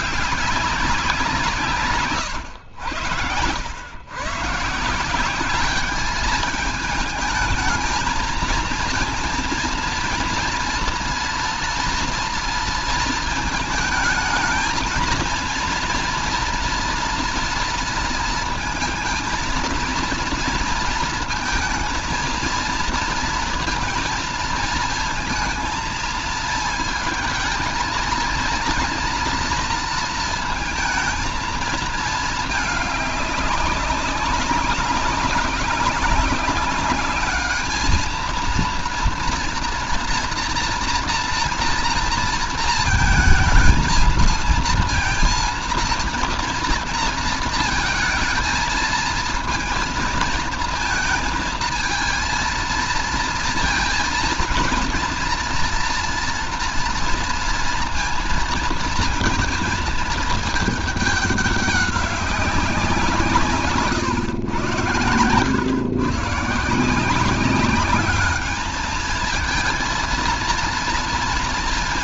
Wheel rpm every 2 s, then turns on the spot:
200, 110, 140, 220, 220, 230, 230, 220, 240, 230, 230, 230, 230, 220, 230, 230, 220, 200, 200, 220, 230, 230, 220, 230, 220, 230, 230, 230, 230, 230, 220, 190, 120, 150, 210, 230.
none